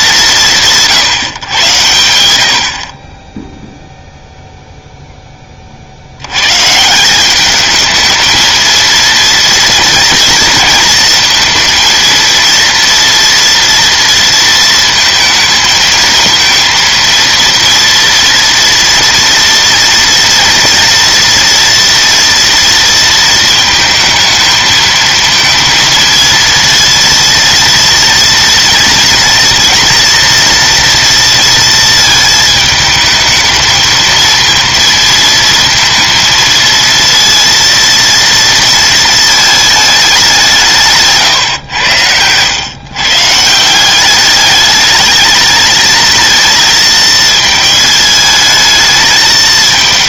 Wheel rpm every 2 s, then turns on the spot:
160, 40, 0, 150, 230, 230, 230, 230, 230, 230, 230, 230, 220, 230, 230, 240, 220, 230, 230, 230, 160, 130, 210, 220, 220.
none